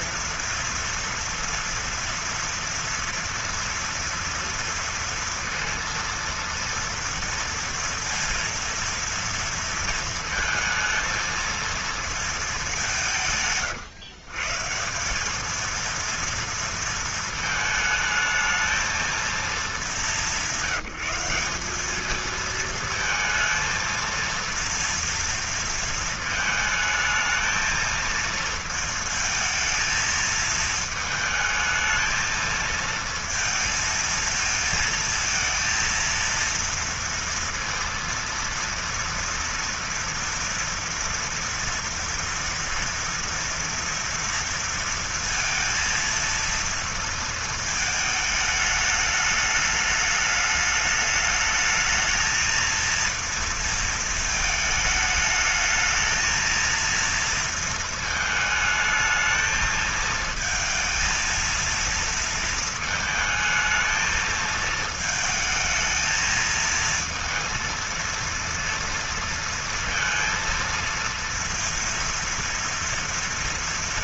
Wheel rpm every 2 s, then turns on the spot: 230, 230, 230, 230, 230, 220, 220, 140, 230, 220, 190, 220, 230, 220, 220, 220, 220, 230, 230, 230, 240, 230, 230, 230, 220, 210, 220, 220, 230, 220, 220, 230, 220, 220, 230, 230, 230.
none